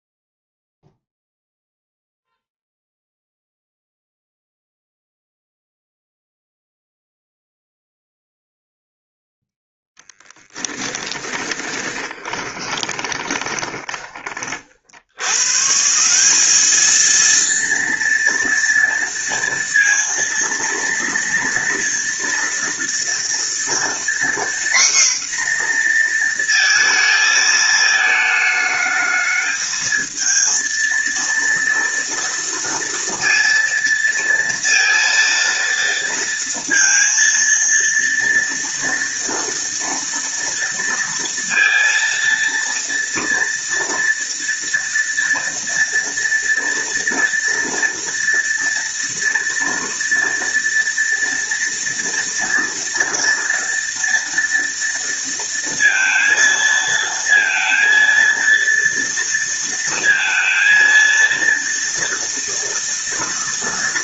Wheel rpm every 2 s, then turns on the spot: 0, 0, 0, 0, 0, 20, 20, 60, 210, 230, 230, 230, 250, 230, 220, 230, 230, 230, 230, 230, 230, 230, 230, 230, 230, 230, 230, 230, 230, 230, 230, 230.
10-14